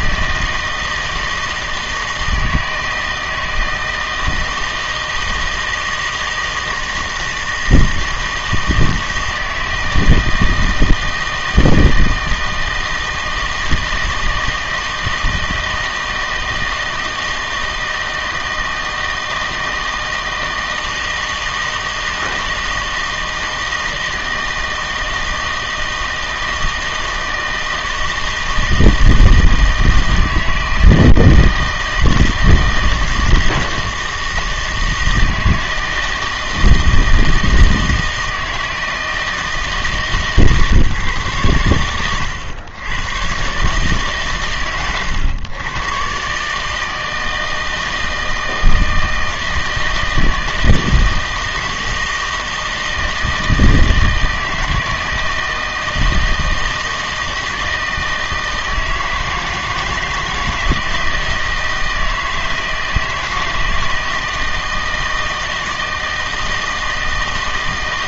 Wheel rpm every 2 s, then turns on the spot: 160, 160, 160, 160, 160, 160, 160, 160, 160, 160, 160, 160, 160, 160, 160, 160, 160, 160, 160, 160, 150, 90, 110, 150, 160, 160, 160, 160, 160, 160, 160, 160, 160, 160.
none